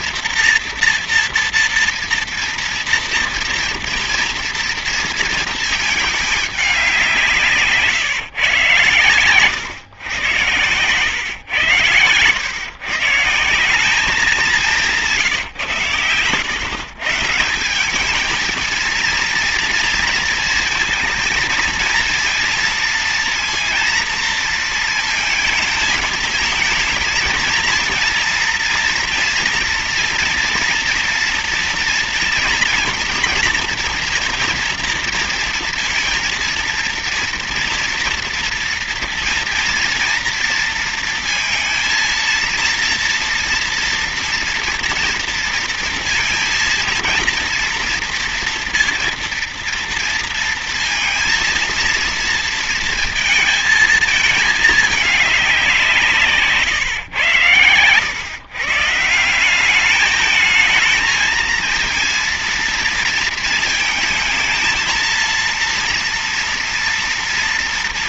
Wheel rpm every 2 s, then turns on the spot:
240, 230, 230, 190, 120, 110, 120, 190, 120, 220, 220, 230, 230, 220, 230, 230, 230, 230, 230, 230, 230, 230, 230, 230, 230, 230, 230, 210, 140, 130, 220, 230, 220, 230.
none